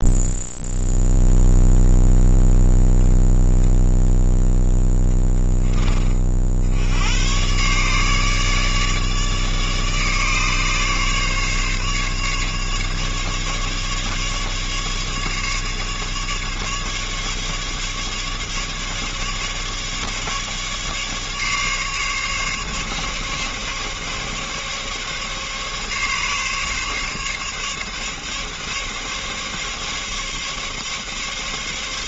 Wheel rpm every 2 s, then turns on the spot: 0, 0, 0, 80, 150, 150, 150, 140, 140, 150, 150, 140, 140, 140, 140, 140.
none